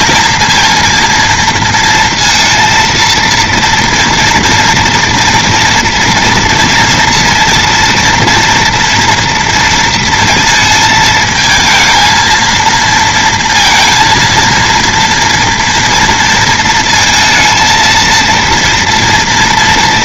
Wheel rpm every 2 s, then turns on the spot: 230, 230, 230, 230, 230, 220, 220, 230, 230, 230.
none